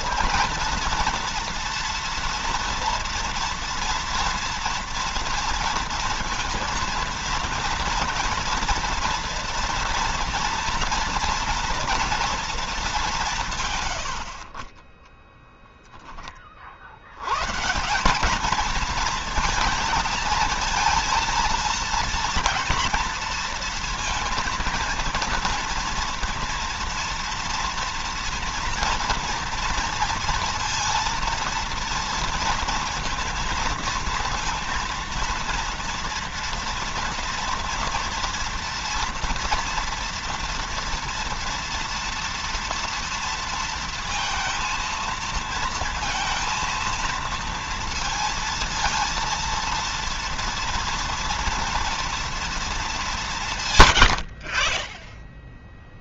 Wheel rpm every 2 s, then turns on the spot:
230, 240, 230, 230, 230, 230, 210, 30, 40, 210, 220, 230, 230, 240, 240, 230, 230, 230, 230, 230, 230, 230, 230, 230, 230, 230, 220, 30.
none